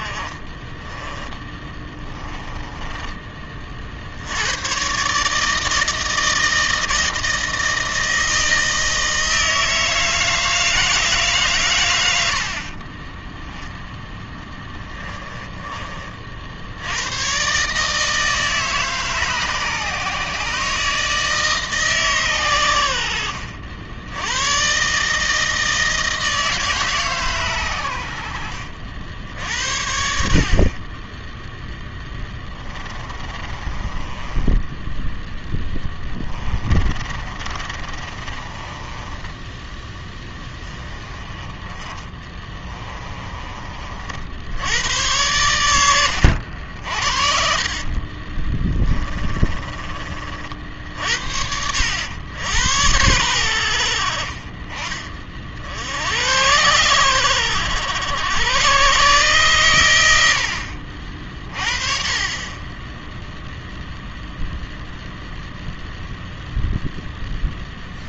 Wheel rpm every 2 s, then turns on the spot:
20, 20, 120, 160, 160, 160, 40, 10, 80, 150, 150, 100, 140, 150, 60, 40, 20, 20, 30, 20, 20, 20, 80, 60, 20, 50, 90, 30, 100, 110, 60, 10, 0, 0.
0-4 14-16 32-40 42-44 48-50